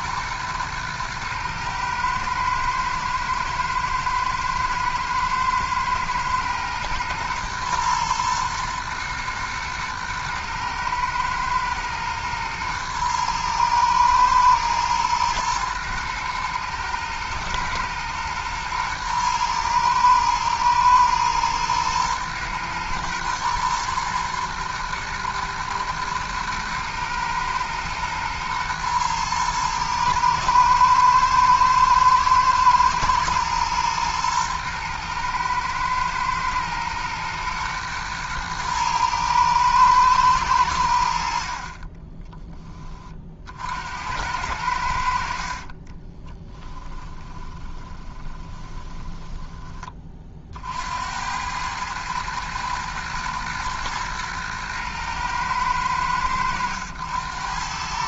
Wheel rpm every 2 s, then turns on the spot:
110, 110, 110, 120, 120, 110, 110, 110, 110, 120, 110, 120, 120, 110, 110, 110, 110, 110, 120, 110, 70, 30, 80, 20, 20, 60, 110, 110, 90.
46-50